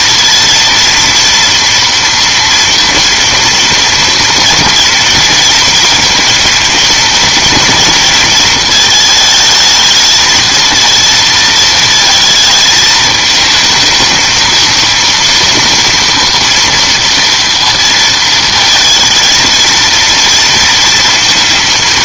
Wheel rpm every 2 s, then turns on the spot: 230, 240, 230, 230, 220, 230, 220, 220, 230, 230, 230.
none